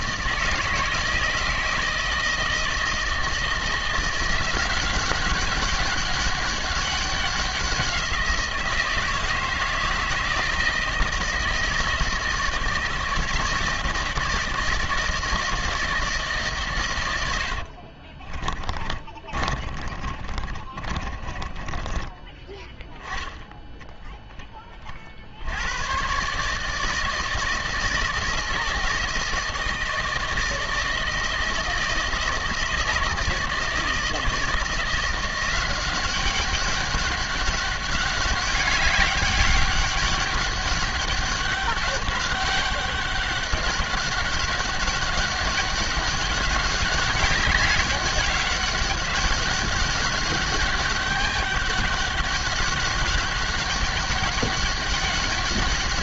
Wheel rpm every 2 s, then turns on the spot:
160, 160, 180, 200, 170, 160, 160, 160, 130, 30, 30, 10, 30, 150, 160, 160, 160, 170, 200, 200, 200, 200, 200, 200, 200, 200, 200, 200.
18-22